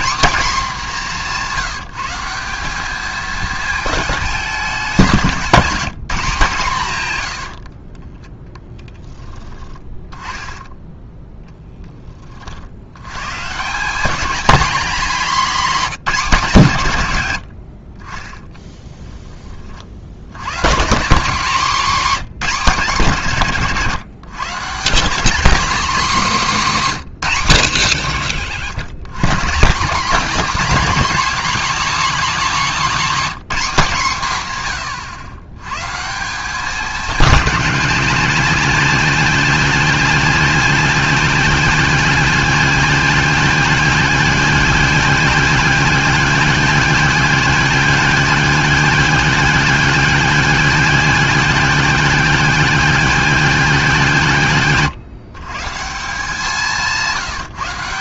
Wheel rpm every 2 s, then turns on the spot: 210, 190, 190, 140, 10, 10, 70, 230, 160, 10, 150, 190, 160, 230, 130, 270, 240, 130, 210, 220, 220, 220, 220, 210, 210, 210, 210, 150, 170.
18-20